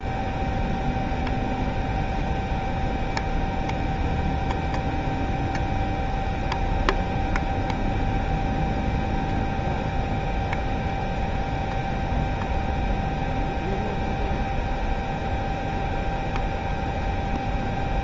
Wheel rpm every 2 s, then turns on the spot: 0, 0, 0, 0, 0, 0, 0, 0, 0.
none